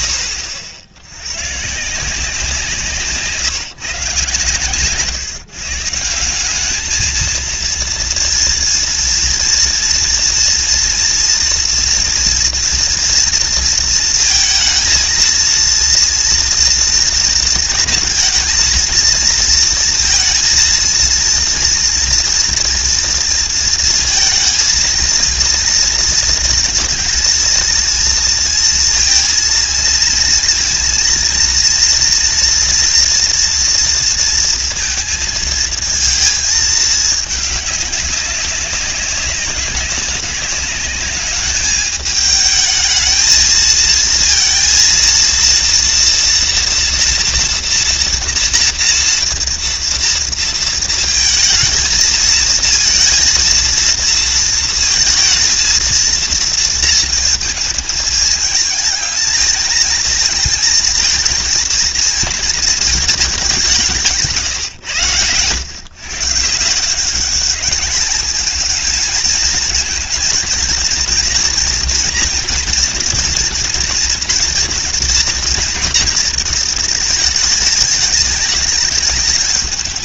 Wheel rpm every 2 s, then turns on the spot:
70, 150, 140, 220, 230, 230, 230, 220, 230, 230, 230, 230, 230, 230, 230, 230, 240, 230, 210, 190, 200, 220, 230, 240, 230, 220, 230, 220, 230, 220, 230, 210, 110, 190, 220, 240, 240, 230, 220, 210.
none